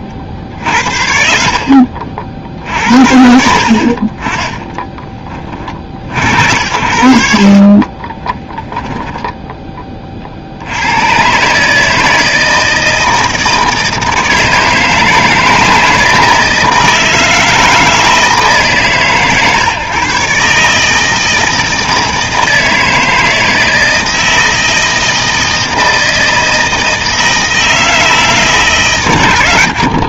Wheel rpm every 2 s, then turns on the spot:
60, 70, 20, 80, 10, 60, 160, 160, 160, 150, 150, 160, 160, 160, 140.
0-2